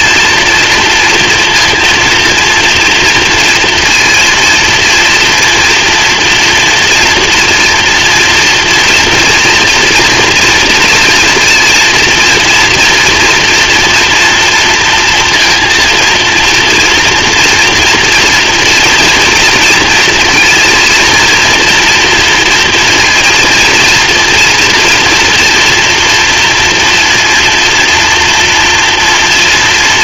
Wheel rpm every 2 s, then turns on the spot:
230, 230, 230, 230, 230, 230, 230, 230, 230, 240, 230, 230, 230, 240, 230.
none